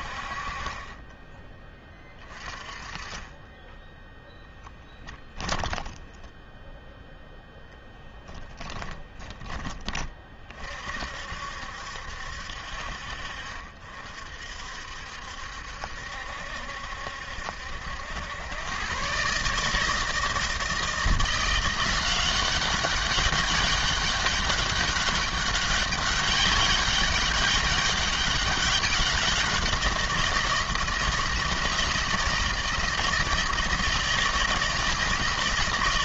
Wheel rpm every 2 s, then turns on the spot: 30, 20, 10, 0, 10, 50, 60, 60, 70, 120, 160, 190, 200, 200, 190, 160, 160, 160.
0-2 4-6